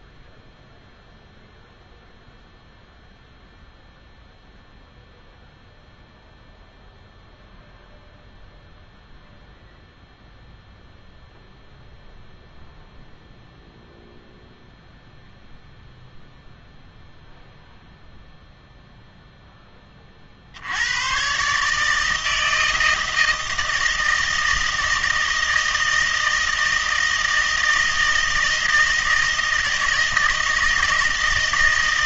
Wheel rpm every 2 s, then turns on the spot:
0, 0, 0, 0, 0, 0, 0, 0, 0, 0, 70, 160, 160, 160, 160, 160.
none